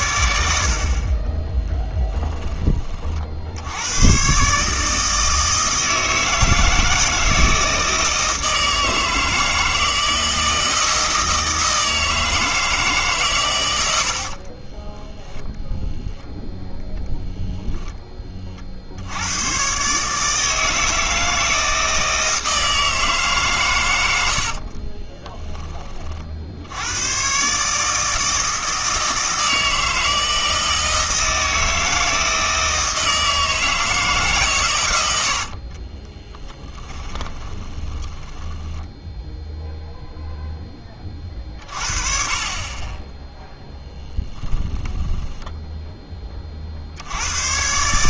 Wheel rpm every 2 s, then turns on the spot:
60, 30, 150, 160, 160, 160, 150, 30, 0, 50, 160, 160, 40, 90, 160, 160, 160, 130, 10, 10, 10, 20, 10, 50.
14-16 24-26 36-40 44-46